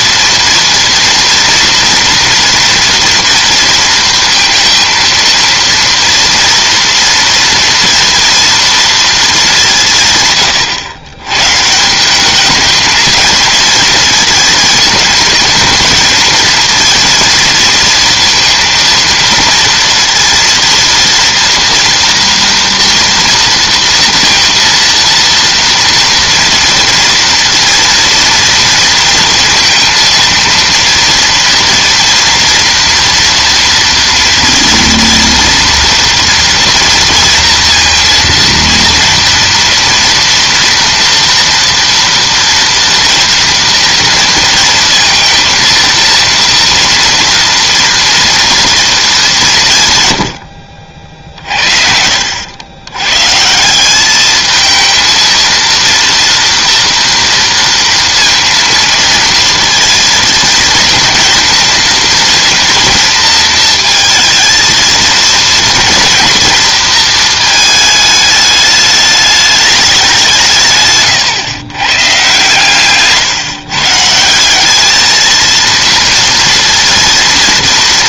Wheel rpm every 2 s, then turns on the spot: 230, 230, 230, 230, 230, 130, 220, 220, 220, 230, 230, 230, 230, 230, 230, 230, 230, 230, 230, 230, 230, 230, 230, 230, 230, 80, 110, 220, 230, 230, 230, 230, 230, 220, 210, 140, 130, 200, 230.
none